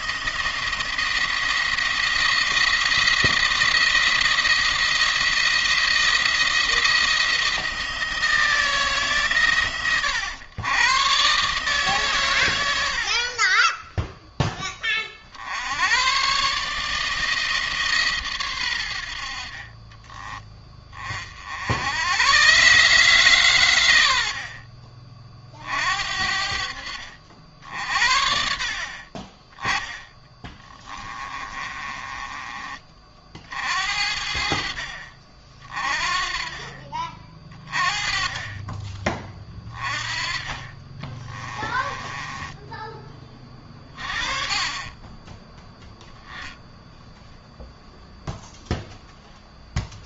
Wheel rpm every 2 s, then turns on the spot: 170, 170, 170, 170, 160, 120, 90, 20, 150, 110, 30, 130, 50, 60, 60, 20, 30, 50, 30, 30, 30, 20, 30, 0, 0.
30-32 40-42